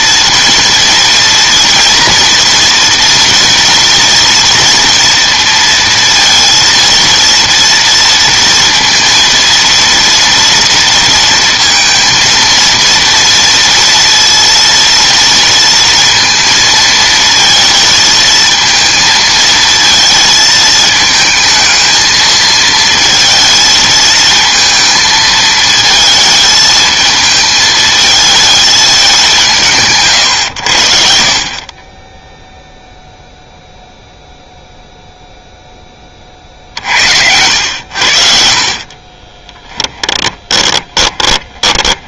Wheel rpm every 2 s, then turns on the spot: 230, 230, 230, 230, 230, 230, 230, 230, 230, 220, 220, 220, 230, 220, 210, 100, 0, 0, 50, 40, 20.
38-42